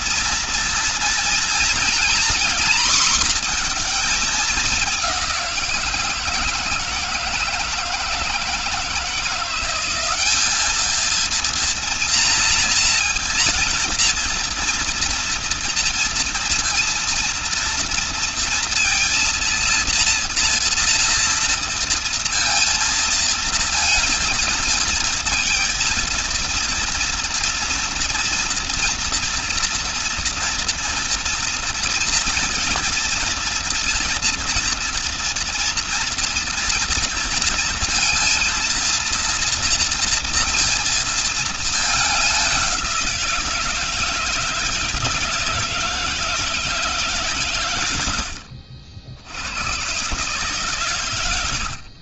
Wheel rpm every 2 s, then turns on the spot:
230, 230, 210, 160, 160, 210, 230, 230, 230, 230, 230, 230, 230, 230, 230, 230, 230, 230, 230, 230, 230, 200, 160, 160, 70, 130.
none